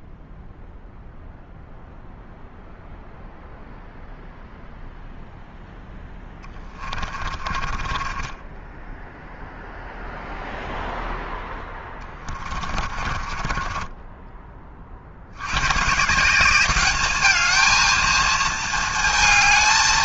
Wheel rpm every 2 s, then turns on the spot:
0, 0, 0, 20, 10, 0, 30, 30, 200, 230.
6-10 12-14